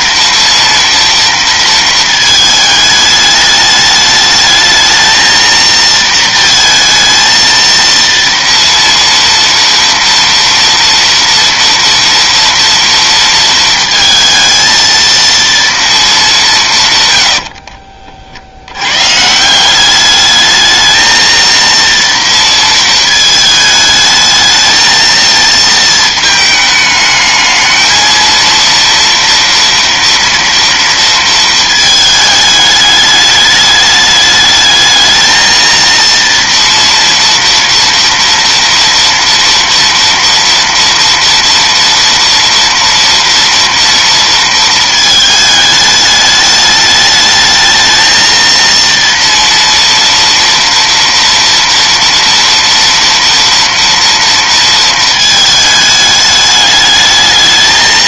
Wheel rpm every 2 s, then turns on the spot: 230, 210, 220, 230, 230, 230, 230, 230, 170, 90, 220, 230, 220, 220, 230, 230, 210, 210, 230, 230, 230, 230, 230, 210, 230, 230, 230, 230, 210.
none